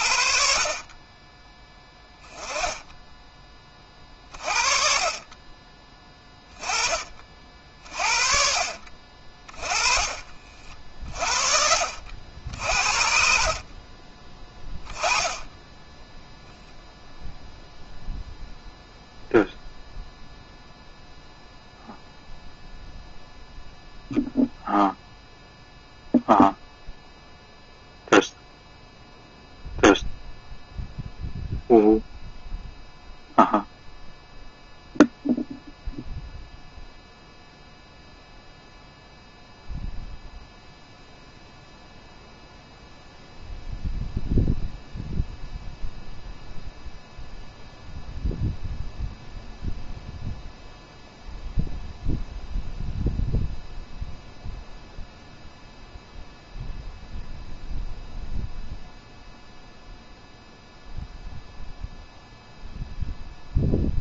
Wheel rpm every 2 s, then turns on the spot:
30, 10, 30, 30, 40, 40, 50, 10, 0, 0, 0, 0, 0, 0, 0, 0, 0, 0, 0, 0, 0, 0, 0, 0, 0, 0, 0, 0, 0, 0, 0, 0.
2-6 10-12